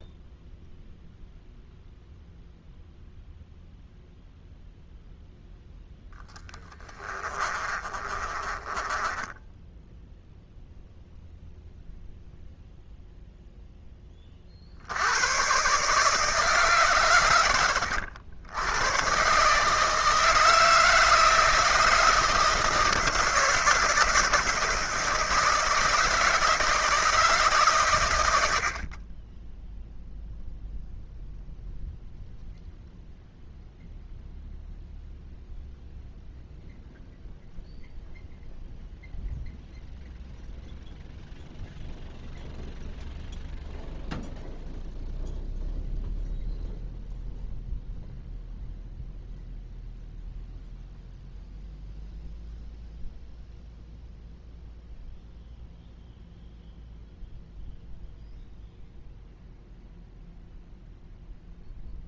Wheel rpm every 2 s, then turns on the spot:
0, 0, 0, 20, 20, 0, 0, 90, 130, 120, 160, 160, 160, 150, 30, 0, 0, 0, 0, 0, 0, 0, 0, 0, 0, 0, 0, 0, 0, 0, 0.
6-10